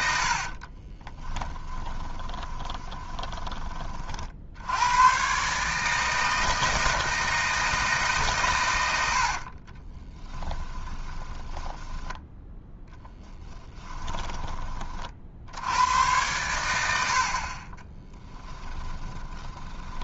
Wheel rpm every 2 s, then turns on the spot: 30, 20, 90, 160, 100, 20, 10, 40, 90, 20.
0-4 10-14 18-20